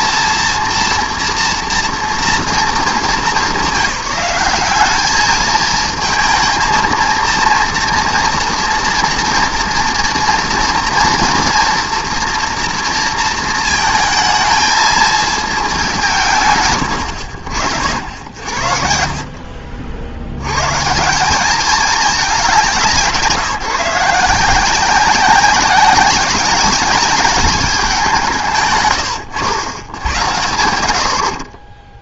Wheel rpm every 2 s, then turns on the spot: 230, 230, 190, 230, 230, 240, 230, 220, 130, 60, 120, 190, 170, 200, 130, 100.
none